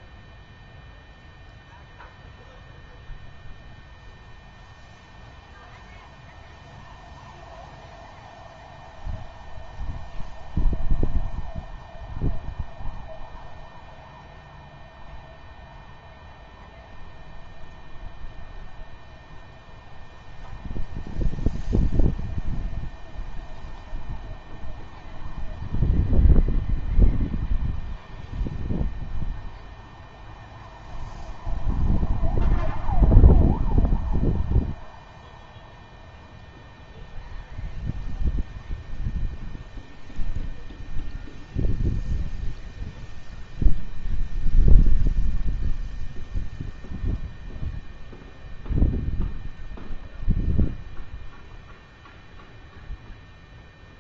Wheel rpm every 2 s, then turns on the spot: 0, 0, 0, 0, 0, 0, 0, 0, 0, 0, 0, 0, 0, 0, 0, 0, 0, 0, 0, 0, 0, 0, 0, 0, 0, 0, 0.
none